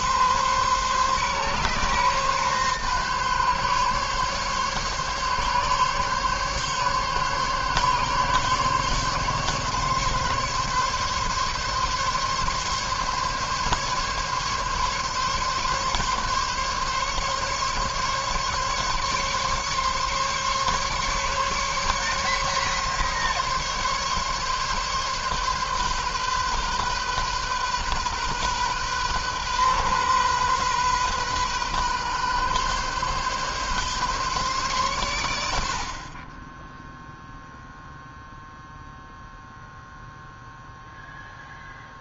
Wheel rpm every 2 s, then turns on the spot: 140, 140, 140, 140, 140, 140, 140, 140, 140, 140, 140, 140, 140, 130, 130, 130, 130, 130, 20, 0, 0.
none